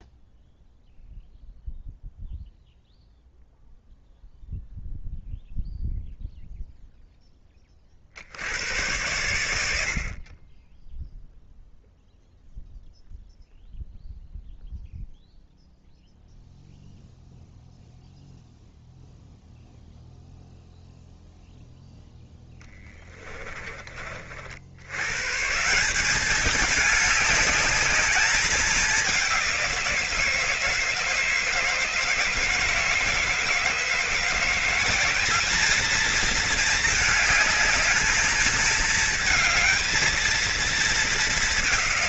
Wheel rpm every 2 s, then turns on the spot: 0, 0, 0, 0, 90, 10, 0, 0, 0, 0, 0, 10, 80, 200, 210, 170, 160, 180, 220, 220, 220.
22-24